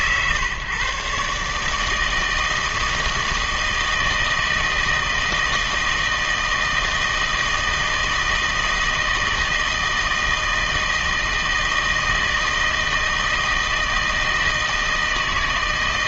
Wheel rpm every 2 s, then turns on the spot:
140, 160, 160, 160, 160, 160, 160, 160.
none